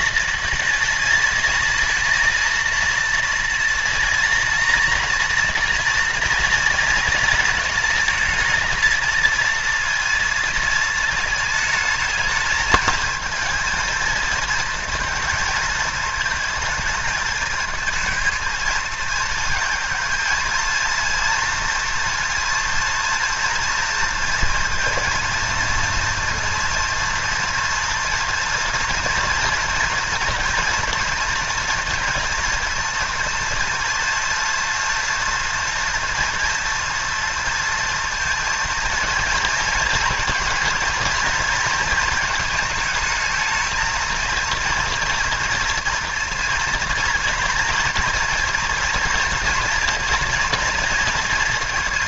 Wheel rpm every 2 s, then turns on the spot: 230, 230, 230, 230, 230, 230, 220, 230, 220, 220, 230, 230, 230, 230, 240, 230, 230, 240, 230, 230, 230, 230, 230, 230, 230, 230.
none